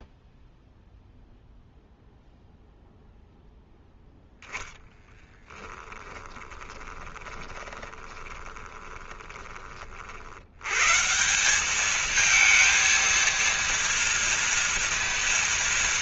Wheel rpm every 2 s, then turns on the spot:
0, 0, 0, 20, 20, 70, 220, 230.
6-10